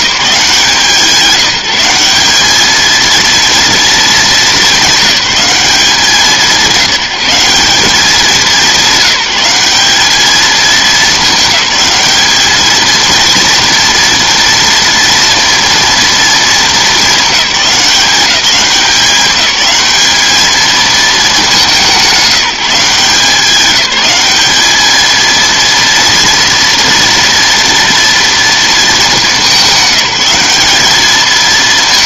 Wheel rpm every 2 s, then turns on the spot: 170, 210, 190, 180, 190, 220, 220, 230, 220, 200, 220, 180, 220, 230, 220, 200.
none